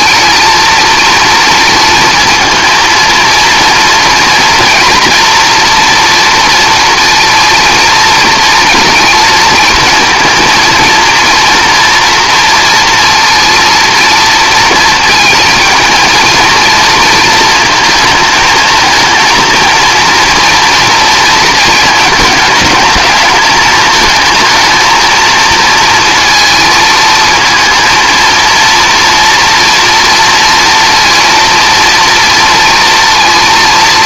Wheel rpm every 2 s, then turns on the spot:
240, 230, 240, 230, 230, 230, 230, 220, 230, 220, 230, 220, 220, 220, 230, 230, 230.
none